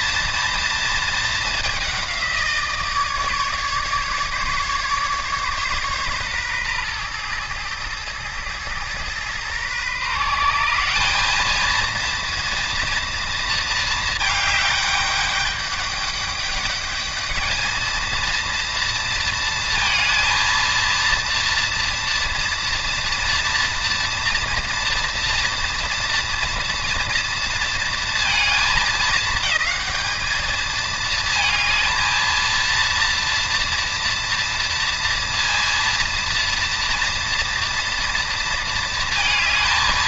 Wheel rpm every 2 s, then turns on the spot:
230, 160, 140, 120, 110, 170, 230, 210, 210, 230, 230, 230, 240, 230, 220, 220, 230, 230, 230, 230.
none